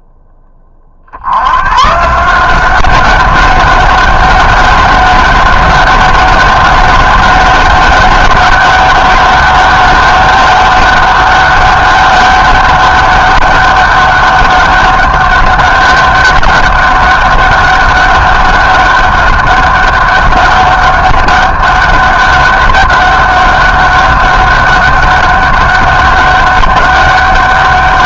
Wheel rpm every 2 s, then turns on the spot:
30, 180, 200, 200, 200, 200, 200, 200, 200, 200, 200, 200, 200, 200.
none